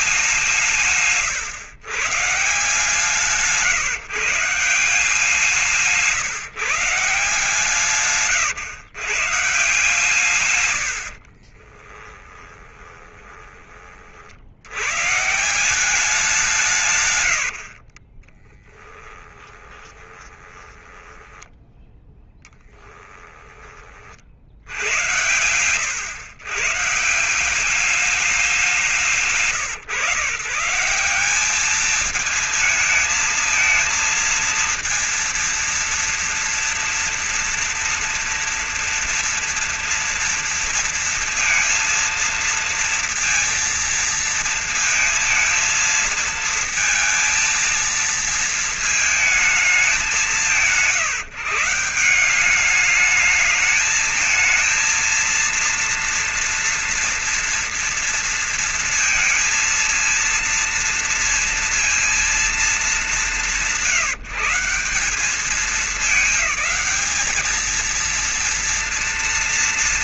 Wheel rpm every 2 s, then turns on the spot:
170, 150, 170, 150, 130, 120, 20, 80, 170, 30, 20, 10, 60, 130, 190, 160, 230, 230, 230, 230, 230, 230, 230, 220, 220, 190, 200, 220, 230, 230, 230, 220, 170, 210, 230.
10-14 18-24